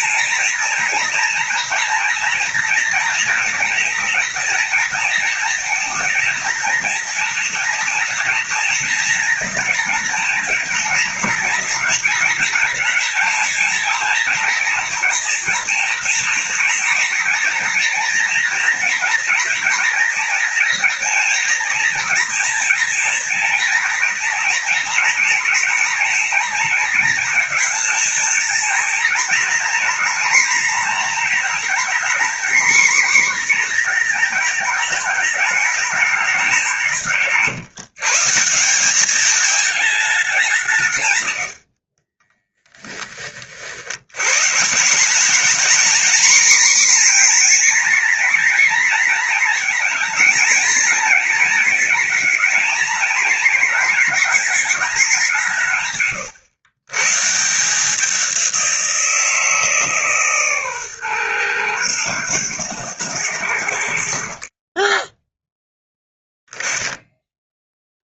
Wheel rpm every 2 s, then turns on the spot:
230, 230, 240, 230, 230, 230, 230, 230, 230, 230, 240, 230, 230, 230, 240, 240, 250, 220, 190, 190, 140, 20, 180, 250, 250, 230, 230, 210, 120, 180, 130, 110, 30, 10.
none